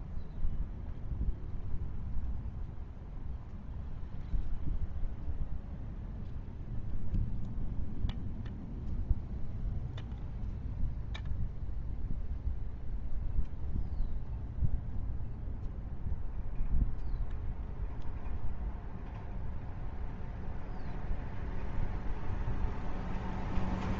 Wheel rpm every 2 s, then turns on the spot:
0, 0, 0, 0, 0, 0, 0, 0, 0, 0, 0, 0.
none